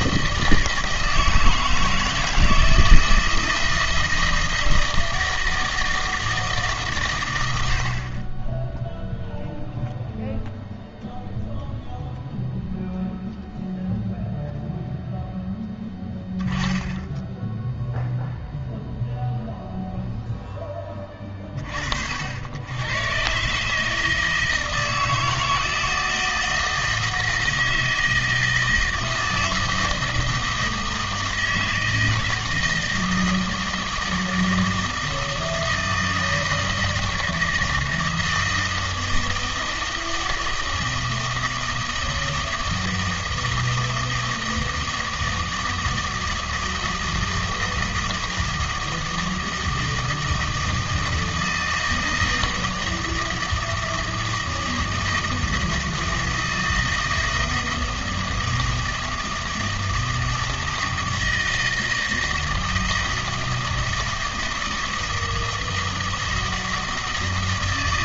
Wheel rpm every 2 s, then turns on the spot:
160, 160, 160, 150, 10, 0, 0, 0, 10, 0, 10, 100, 160, 160, 160, 160, 160, 160, 160, 160, 160, 160, 160, 160, 160, 160, 160, 160, 160, 160, 160, 160, 160, 160.
none